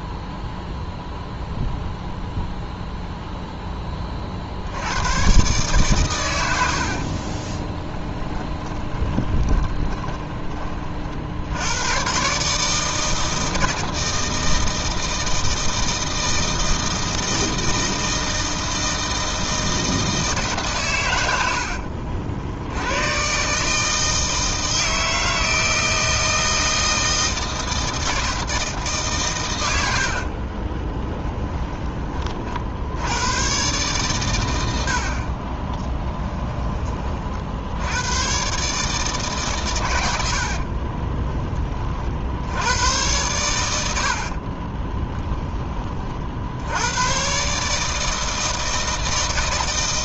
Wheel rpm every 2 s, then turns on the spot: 0, 0, 90, 70, 20, 40, 160, 160, 160, 160, 120, 100, 160, 160, 150, 20, 80, 70, 20, 140, 50, 90, 30, 100, 160.
6-10 30-32 40-42 44-46